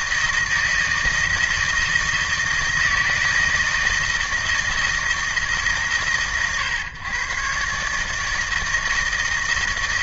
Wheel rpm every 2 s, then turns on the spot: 160, 170, 160, 130, 160.
none